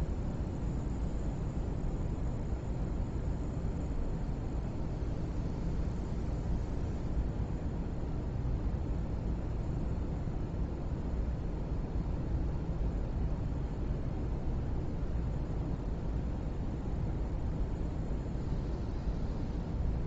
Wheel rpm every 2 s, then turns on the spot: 0, 0, 0, 0, 0, 0, 0, 0, 0, 0.
none